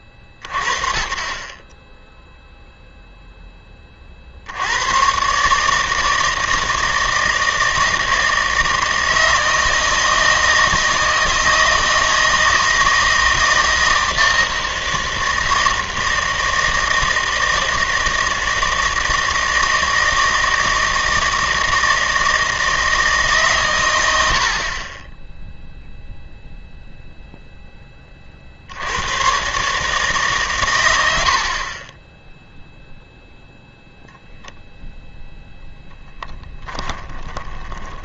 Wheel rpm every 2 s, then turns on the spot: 40, 0, 80, 160, 160, 160, 160, 160, 160, 160, 160, 160, 50, 0, 80, 120, 0, 0, 20.
36-38